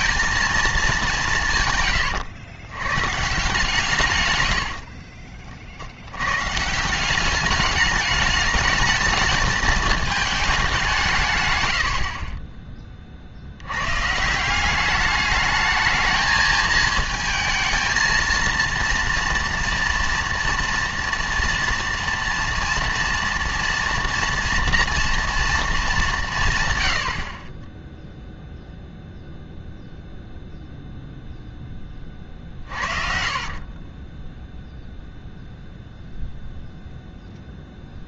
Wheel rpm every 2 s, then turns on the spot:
220, 110, 70, 150, 210, 200, 30, 190, 220, 230, 230, 230, 230, 120, 0, 0, 40, 0, 0.
32-34